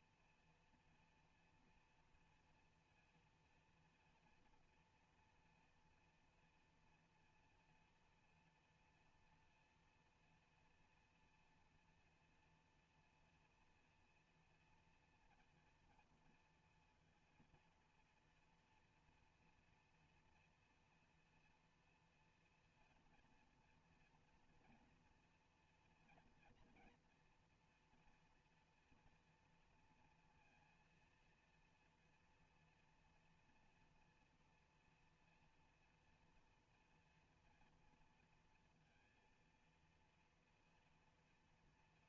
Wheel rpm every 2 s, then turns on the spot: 240, 240, 240, 240, 240, 230, 230, 230, 230, 230, 230, 230, 230, 230, 230, 230, 230, 240, 230, 230, 230.
none